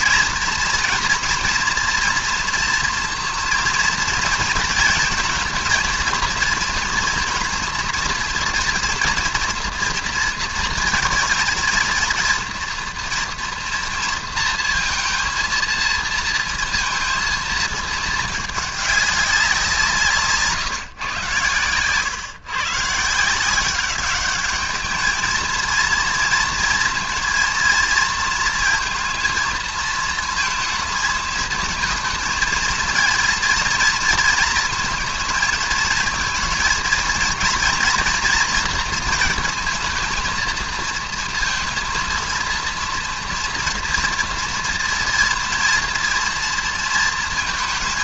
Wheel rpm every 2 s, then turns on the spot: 240, 230, 230, 240, 230, 230, 230, 230, 230, 210, 140, 140, 210, 230, 230, 220, 230, 230, 230, 230, 230, 230, 230, 230.
none